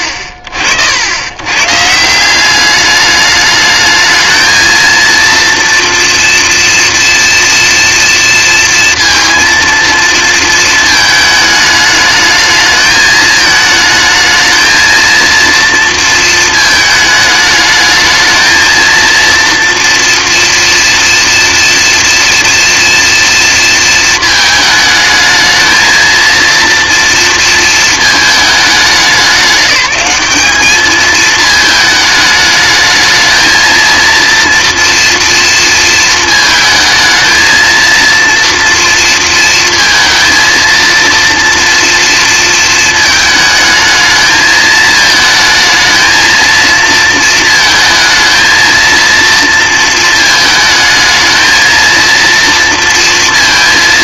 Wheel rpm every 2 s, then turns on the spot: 80, 200, 230, 230, 230, 220, 220, 220, 220, 230, 230, 230, 220, 230, 210, 210, 210, 230, 220, 240, 230, 220, 220, 230, 230, 220, 230.
none